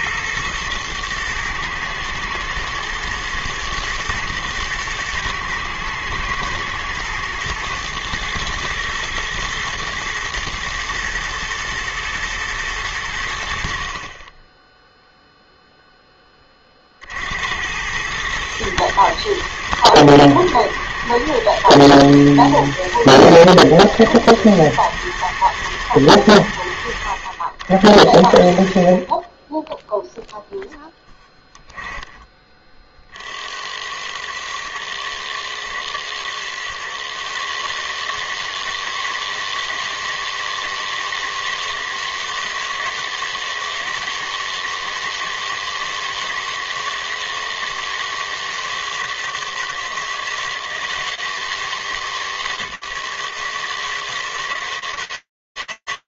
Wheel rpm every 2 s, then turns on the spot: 110, 110, 110, 110, 120, 120, 90, 0, 50, 110, 120, 110, 120, 80, 50, 0, 40, 110, 130, 160, 160, 160, 160, 160, 160, 160, 140, 160.
none